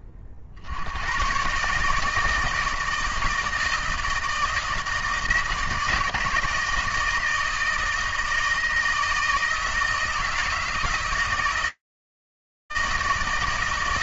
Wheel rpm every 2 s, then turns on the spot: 60, 160, 160, 160, 160, 160, 160.
none